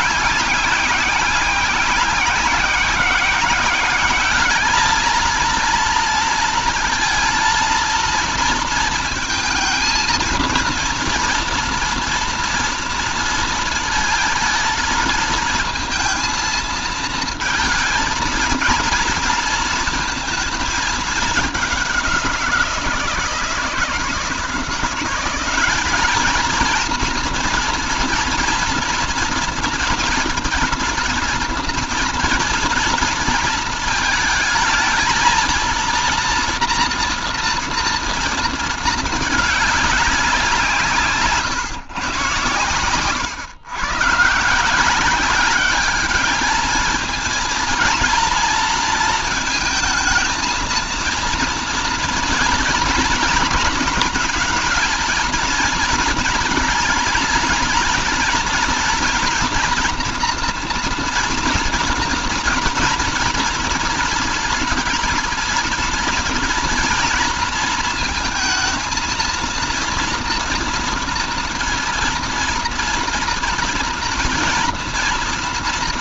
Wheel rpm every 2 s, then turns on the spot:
190, 190, 210, 230, 230, 230, 230, 220, 220, 230, 220, 170, 170, 230, 230, 230, 230, 230, 230, 220, 160, 110, 170, 220, 220, 230, 230, 230, 230, 240, 240, 230, 230, 230, 220, 230, 230, 230.
none